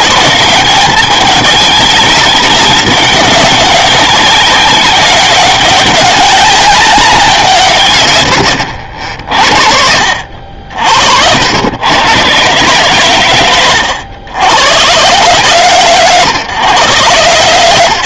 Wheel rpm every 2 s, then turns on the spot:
190, 190, 190, 190, 70, 70, 130, 120, 130.
none